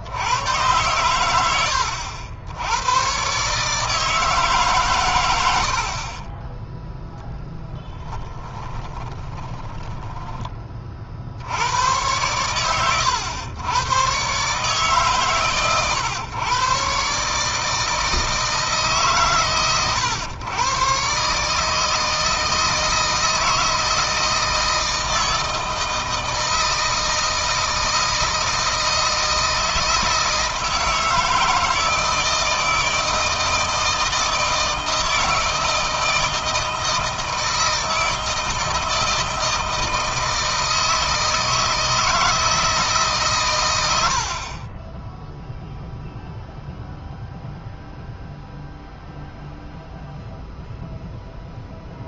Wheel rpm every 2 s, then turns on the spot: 100, 100, 130, 10, 20, 30, 110, 150, 140, 150, 120, 160, 160, 160, 160, 160, 160, 160, 160, 160, 160, 150, 20, 0, 0, 0.
8-10